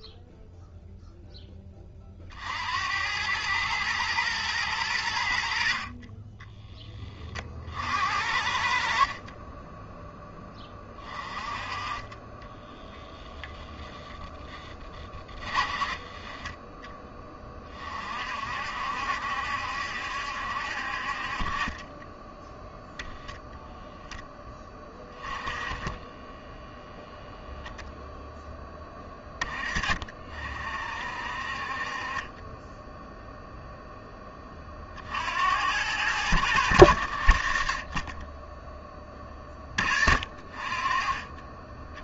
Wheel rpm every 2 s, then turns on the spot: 0, 80, 100, 20, 60, 20, 10, 20, 10, 60, 60, 0, 10, 0, 10, 50, 10, 50, 90, 10, 40.
14-16